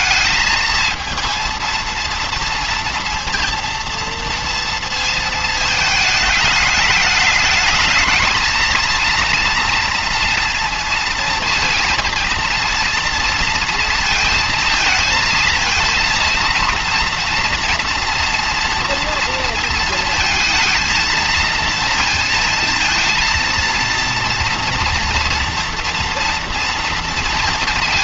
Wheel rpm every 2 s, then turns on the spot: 220, 230, 230, 210, 230, 230, 230, 220, 230, 230, 220, 230, 240, 240.
none